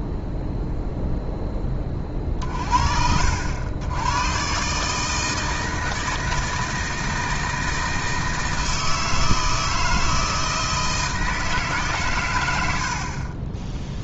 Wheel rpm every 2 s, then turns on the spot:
0, 50, 130, 160, 160, 160, 100.
12-14